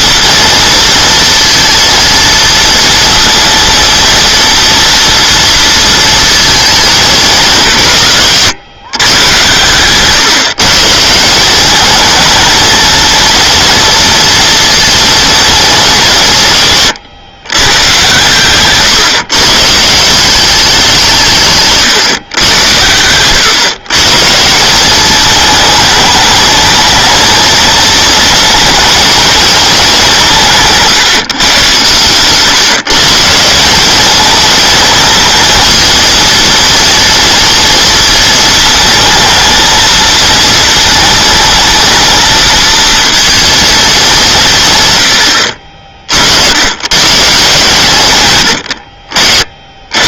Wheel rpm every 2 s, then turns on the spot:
230, 230, 230, 220, 140, 140, 230, 230, 150, 130, 180, 100, 180, 220, 220, 170, 150, 220, 230, 230, 230, 230, 130, 100, 90.
none